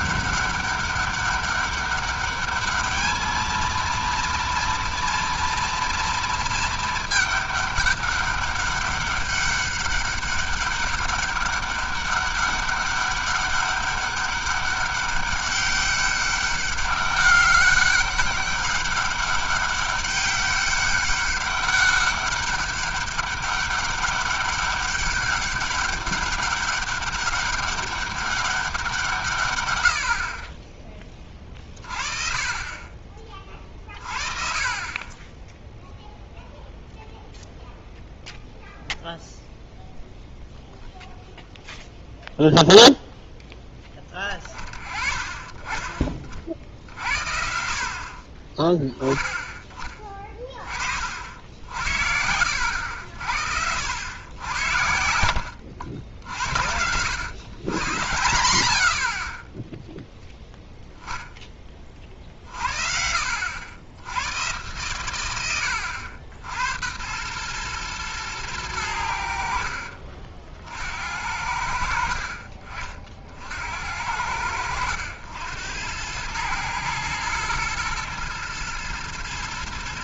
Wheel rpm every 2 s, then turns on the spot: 200, 210, 230, 220, 200, 200, 200, 200, 200, 200, 200, 200, 200, 200, 190, 30, 30, 30, 0, 0, 0, 0, 30, 50, 30, 30, 70, 90, 80, 70, 0, 50, 110, 80, 100, 60, 40, 90, 110, 120.
52-54